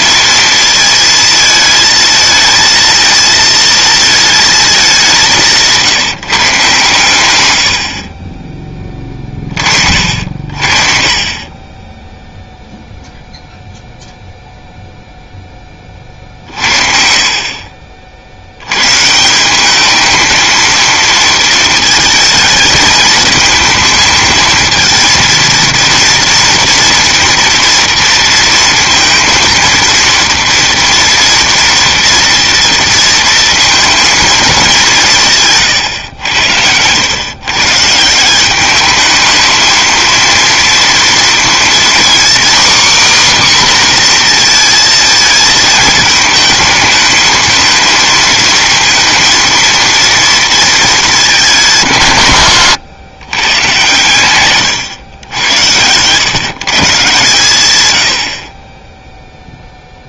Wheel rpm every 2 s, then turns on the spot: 230, 220, 210, 150, 20, 60, 0, 0, 50, 90, 220, 220, 230, 230, 230, 230, 230, 200, 100, 200, 230, 270, 230, 220, 220, 220, 120, 120, 140, 0.
54-56